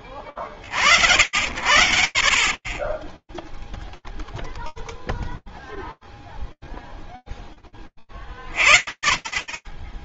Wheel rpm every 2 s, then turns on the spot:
20, 0, 0, 10, 0.
none